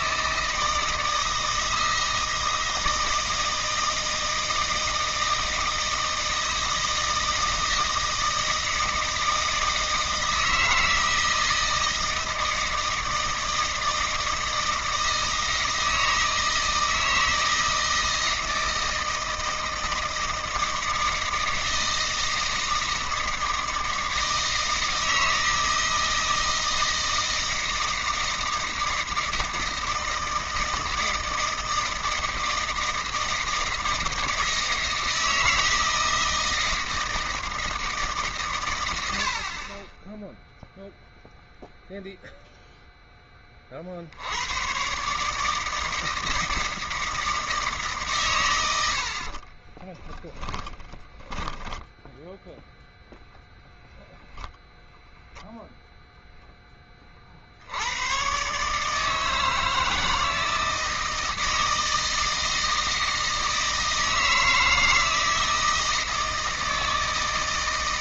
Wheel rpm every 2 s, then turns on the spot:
160, 160, 160, 160, 160, 160, 160, 160, 160, 160, 160, 160, 160, 160, 160, 160, 160, 160, 160, 120, 0, 0, 90, 160, 120, 10, 0, 0, 10, 130, 160, 160, 160, 160.
50-52